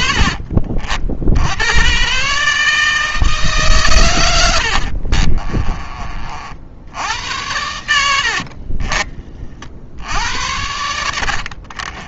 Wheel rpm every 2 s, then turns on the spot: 60, 160, 60, 80, 30, 70.
4-6 10-12